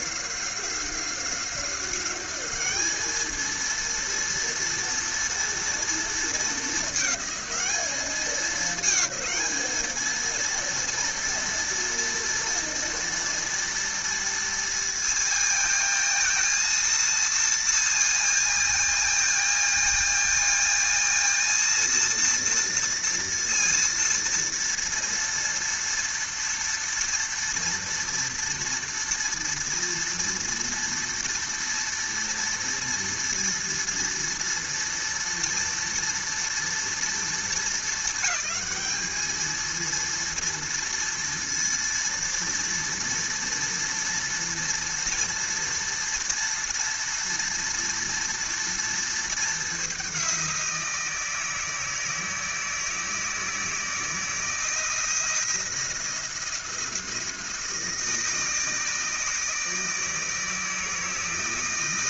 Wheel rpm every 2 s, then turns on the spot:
190, 210, 230, 220, 220, 230, 230, 230, 230, 220, 230, 230, 230, 230, 230, 230, 230, 230, 230, 220, 230, 230, 230, 230, 230, 170, 160, 170, 170, 160, 160.
none